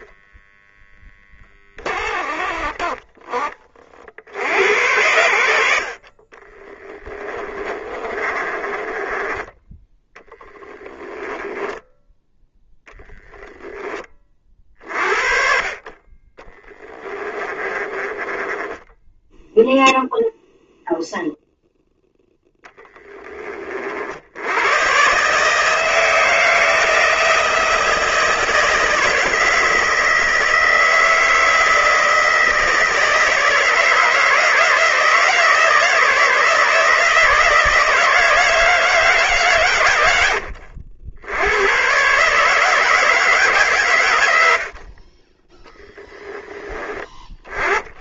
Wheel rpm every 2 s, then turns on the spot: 10, 30, 90, 20, 20, 10, 10, 40, 20, 10, 0, 10, 130, 170, 160, 160, 160, 160, 160, 160, 80, 160, 40, 10.
6-12 16-20